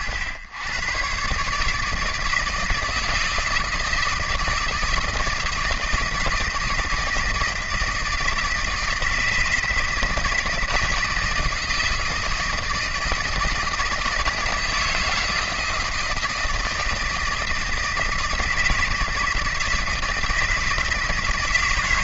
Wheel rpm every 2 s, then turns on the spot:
110, 160, 160, 170, 160, 160, 160, 160, 160, 160, 160.
none